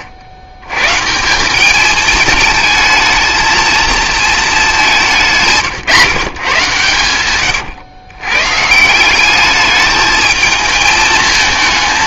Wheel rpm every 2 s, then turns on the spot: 130, 220, 200, 130, 190, 220.
none